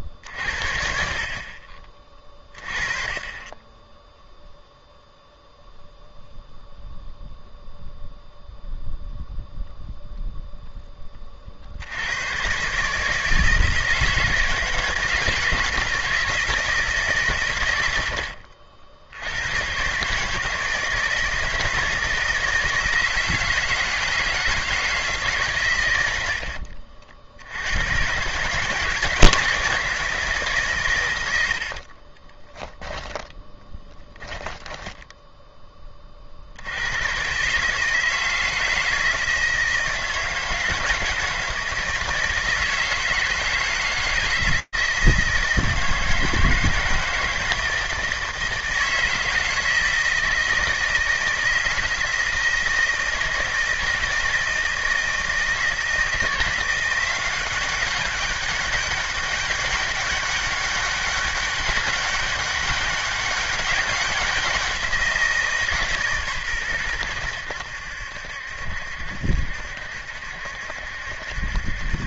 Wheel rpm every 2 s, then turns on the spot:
40, 30, 0, 0, 0, 10, 140, 160, 150, 80, 160, 160, 160, 60, 150, 130, 10, 10, 100, 160, 160, 170, 160, 160, 160, 170, 160, 160, 180, 200, 200, 200, 180, 120, 70, 70.
34-36